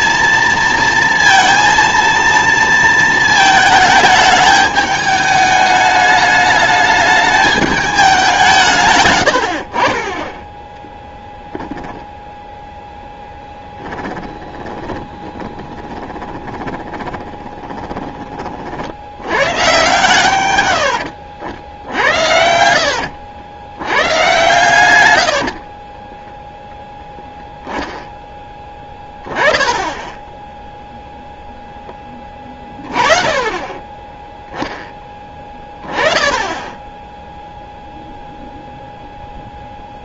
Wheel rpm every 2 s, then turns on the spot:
230, 230, 210, 210, 140, 10, 0, 10, 20, 60, 90, 70, 110, 0, 10, 0, 30, 10, 10, 0.
14-18 22-24